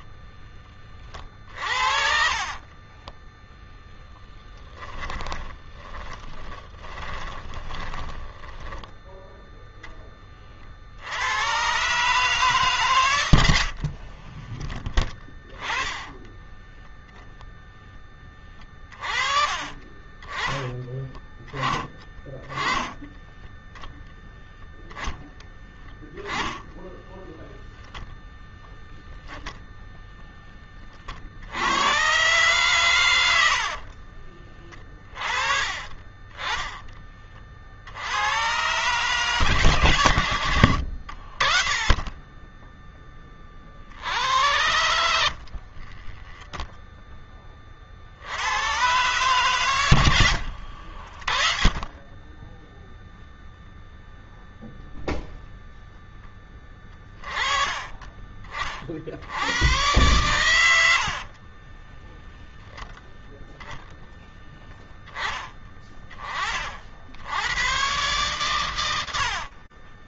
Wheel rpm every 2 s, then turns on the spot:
10, 30, 10, 20, 10, 30, 140, 30, 10, 30, 20, 20, 10, 10, 0, 20, 120, 30, 20, 100, 90, 10, 80, 20, 90, 90, 10, 0, 10, 40, 100, 10, 10, 40, 100.
2-10 14-16 24-26 36-38 44-48 60-62